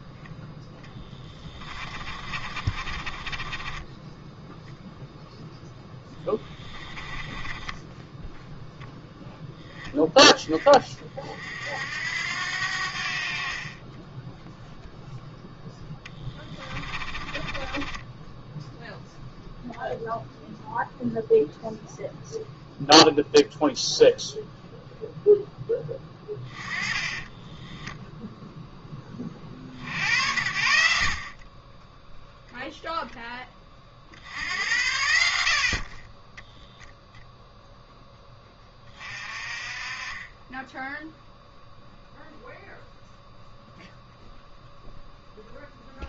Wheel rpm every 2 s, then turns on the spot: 10, 40, 0, 30, 0, 20, 70, 0, 20, 0, 0, 0, 0, 20, 10, 70, 10, 90, 0, 20, 10, 0, 0.
0-4 6-8 16-18 26-28